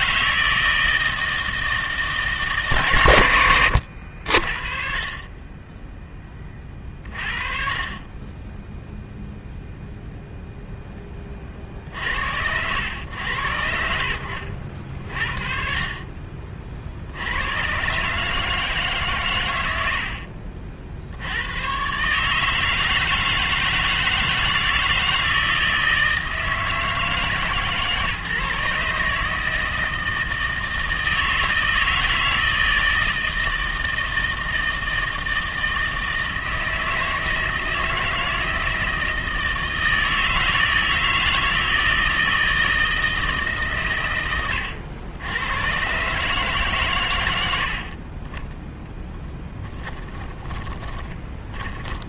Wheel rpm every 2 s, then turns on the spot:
120, 30, 40, 0, 0, 110, 60, 30, 140, 40, 160, 160, 160, 150, 160, 160, 160, 160, 160, 160, 160, 110, 140, 20, 20, 70.
48-50